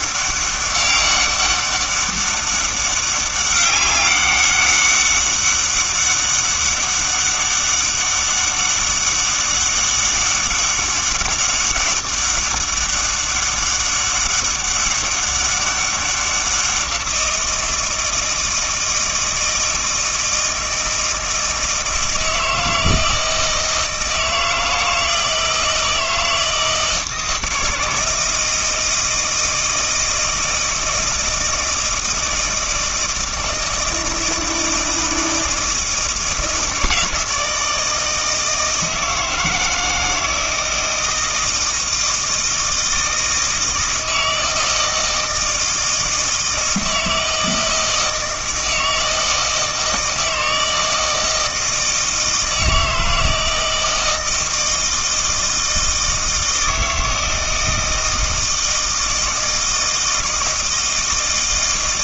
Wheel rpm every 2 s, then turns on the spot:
200, 200, 200, 200, 200, 200, 200, 200, 180, 160, 160, 160, 160, 160, 160, 160, 160, 160, 160, 160, 160, 160, 160, 160, 160, 160, 160, 160, 160, 160, 160.
none